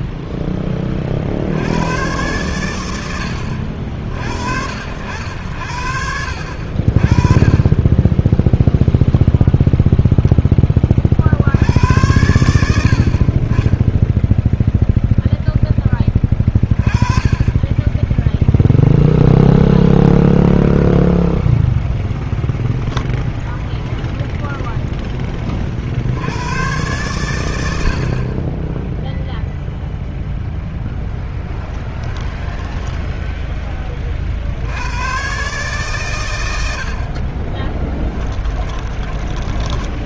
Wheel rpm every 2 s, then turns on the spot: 20, 120, 70, 50, 10, 30, 70, 0, 20, 0, 0, 0, 0, 110, 10, 0, 10, 80, 80, 20.
32-34 38-40